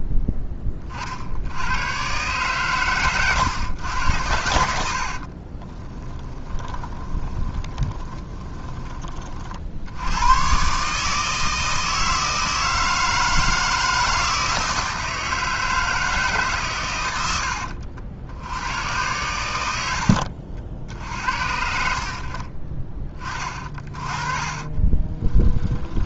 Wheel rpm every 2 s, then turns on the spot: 20, 120, 70, 20, 30, 140, 160, 160, 120, 100, 60, 30, 30.
4-10 24-26